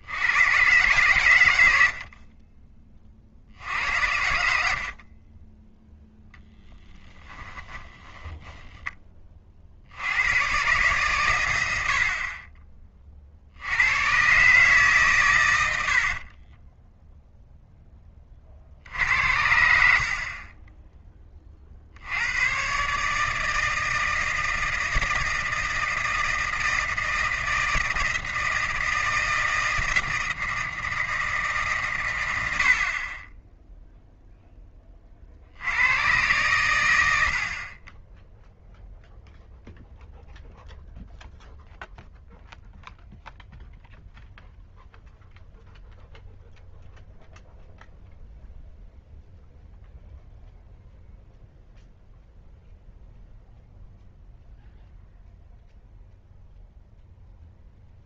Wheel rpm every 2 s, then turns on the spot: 110, 30, 50, 10, 20, 130, 30, 140, 10, 50, 30, 130, 160, 160, 160, 160, 60, 10, 100, 0, 0, 0, 0, 0, 0, 0, 0, 0, 0.
8-10 16-18 20-22